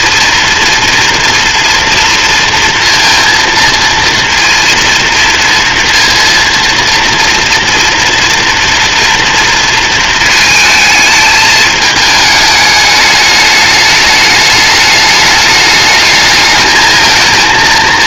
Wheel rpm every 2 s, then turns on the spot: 230, 230, 230, 230, 230, 210, 210, 210, 220.
none